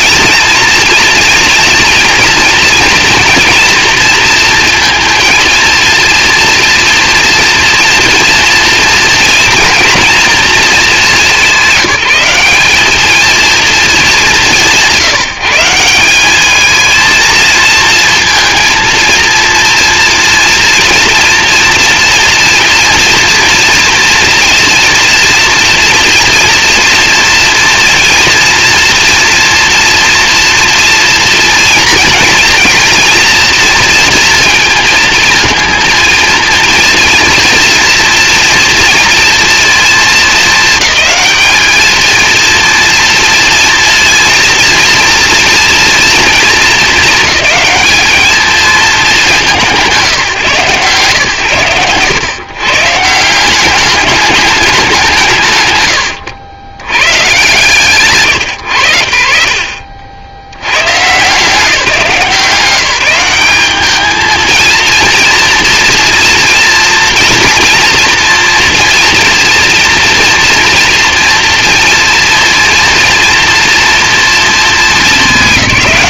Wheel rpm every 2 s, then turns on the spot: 230, 240, 230, 230, 230, 210, 210, 150, 220, 230, 230, 230, 240, 240, 240, 230, 240, 230, 230, 240, 210, 230, 240, 220, 230, 140, 160, 180, 90, 90, 120, 180, 230, 230, 240, 240, 230, 200.
none